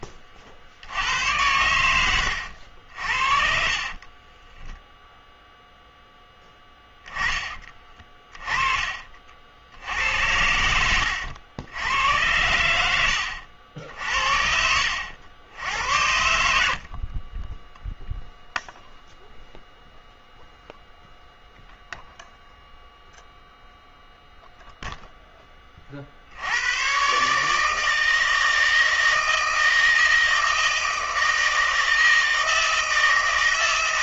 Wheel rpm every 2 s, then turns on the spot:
80, 80, 10, 10, 30, 90, 100, 70, 60, 0, 0, 0, 0, 90, 160, 160, 160.
2-6 10-12 16-18